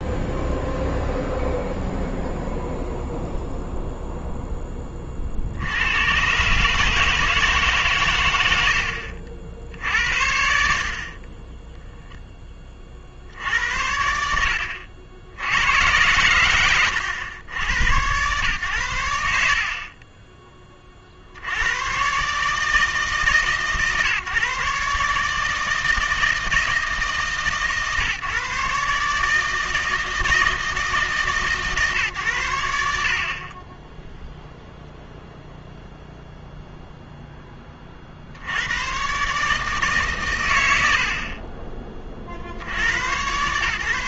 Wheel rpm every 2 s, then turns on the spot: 0, 0, 10, 140, 70, 90, 10, 80, 100, 90, 20, 150, 140, 160, 140, 160, 90, 0, 0, 80, 110, 70.
8-10